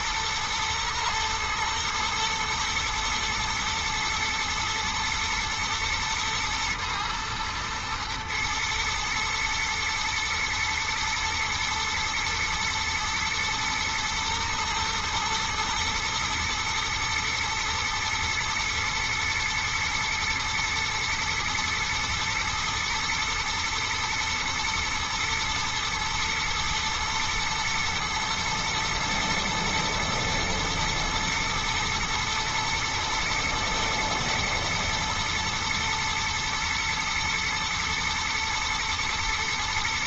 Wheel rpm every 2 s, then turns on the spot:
120, 120, 120, 110, 120, 120, 110, 110, 110, 120, 120, 120, 110, 110, 120, 120, 110, 110, 110, 110.
none